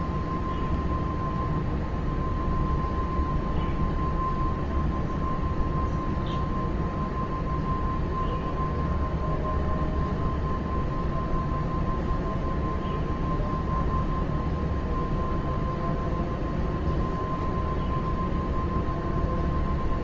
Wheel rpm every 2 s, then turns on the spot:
0, 0, 0, 0, 0, 0, 0, 0, 0, 0.
none